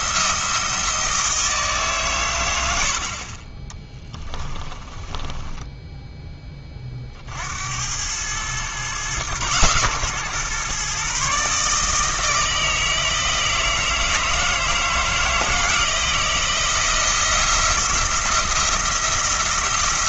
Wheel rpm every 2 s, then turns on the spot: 170, 80, 10, 50, 120, 140, 160, 160, 170, 160.
4-6